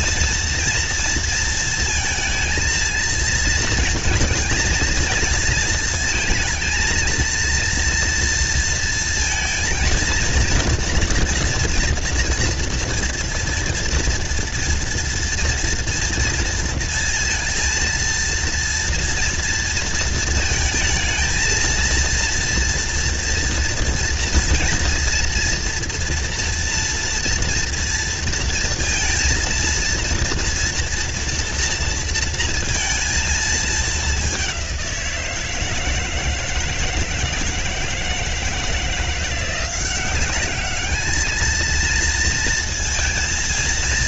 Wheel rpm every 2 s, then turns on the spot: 230, 230, 230, 230, 230, 230, 230, 230, 230, 230, 230, 230, 240, 230, 230, 230, 230, 190, 160, 170, 210, 230.
none